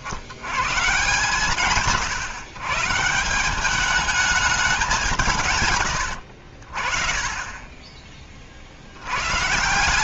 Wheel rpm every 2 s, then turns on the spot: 120, 140, 200, 50, 60.
none